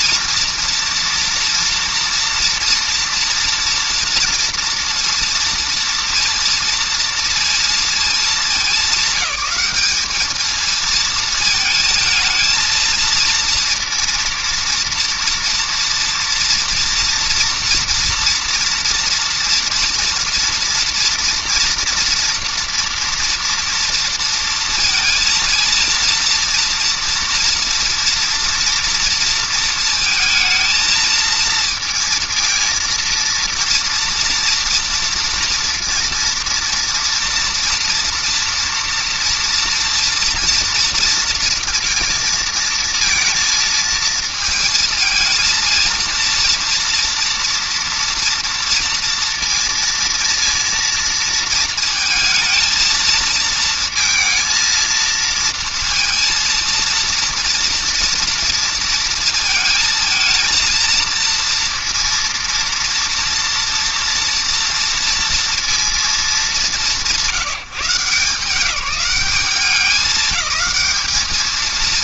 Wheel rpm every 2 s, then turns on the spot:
230, 240, 230, 230, 220, 220, 230, 230, 240, 240, 230, 240, 230, 230, 230, 220, 230, 230, 230, 230, 230, 230, 220, 230, 230, 230, 230, 230, 230, 230, 220, 230, 230, 200, 180, 210.
none